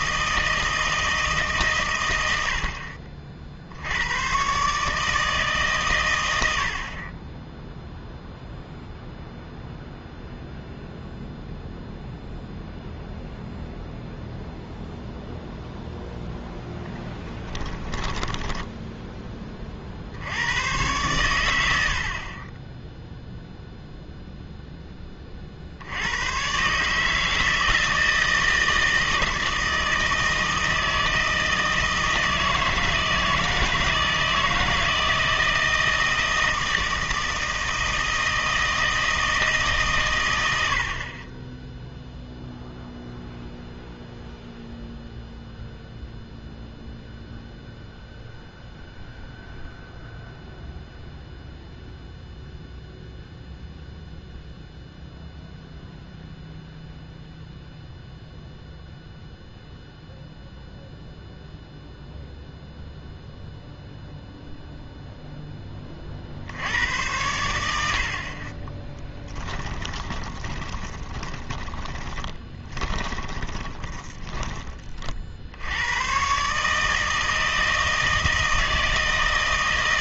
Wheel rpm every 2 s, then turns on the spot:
160, 60, 140, 70, 0, 0, 0, 0, 0, 10, 110, 10, 10, 140, 160, 160, 160, 160, 160, 160, 70, 0, 0, 0, 0, 0, 0, 0, 0, 0, 0, 0, 0, 80, 10, 20, 20, 30, 150, 160.
68-74